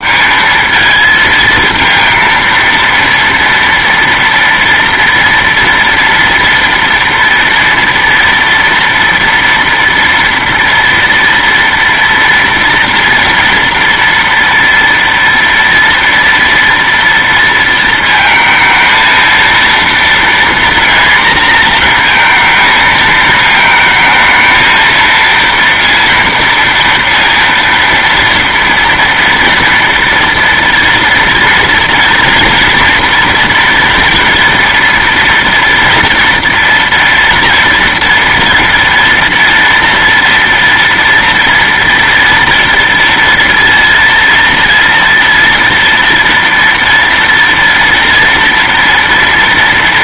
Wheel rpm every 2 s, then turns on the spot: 220, 230, 230, 230, 230, 230, 230, 230, 230, 220, 230, 230, 220, 230, 230, 230, 230, 230, 230, 240, 230, 230, 230, 230, 230.
none